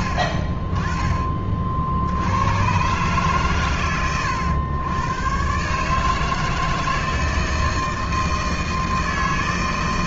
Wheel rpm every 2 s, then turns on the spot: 30, 110, 110, 160, 160.
none